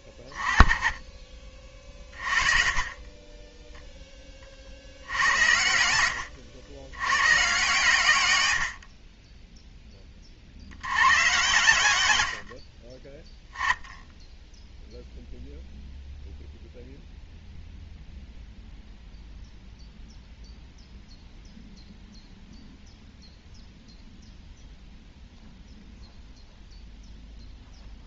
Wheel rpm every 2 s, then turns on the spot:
20, 30, 70, 100, 40, 100, 20, 0, 0, 0, 0, 0, 0, 0.
2-6